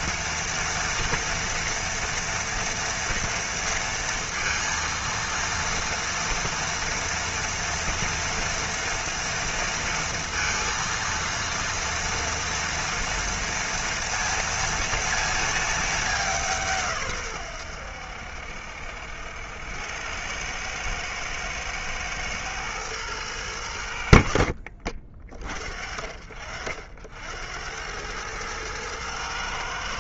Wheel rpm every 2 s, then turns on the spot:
240, 230, 230, 230, 230, 230, 230, 230, 170, 70, 100, 110, 60, 60, 110.
none